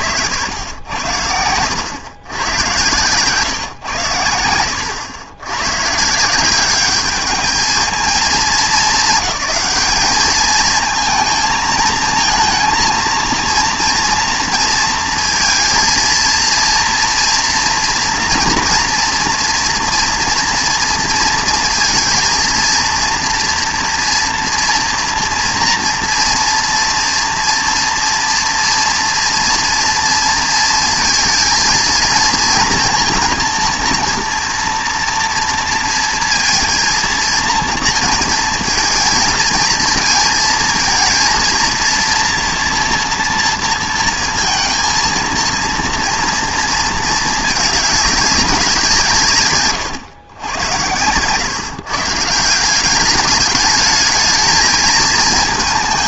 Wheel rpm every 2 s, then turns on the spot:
80, 130, 90, 190, 200, 220, 230, 230, 230, 240, 230, 230, 240, 230, 230, 230, 230, 230, 230, 230, 220, 230, 230, 230, 190, 110, 180, 220.
none